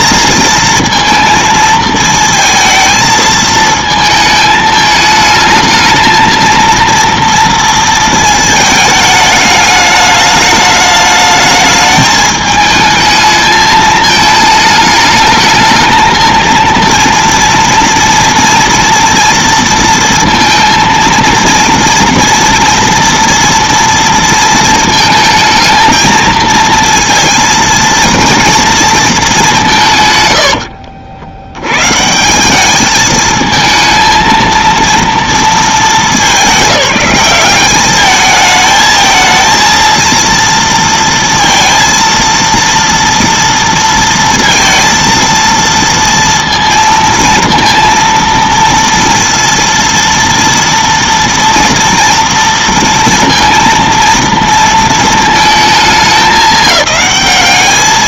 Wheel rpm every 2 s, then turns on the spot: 230, 220, 220, 230, 220, 210, 220, 220, 230, 240, 230, 230, 230, 220, 230, 80, 200, 230, 200, 220, 230, 230, 230, 230, 230, 230, 230, 230, 190.
30-32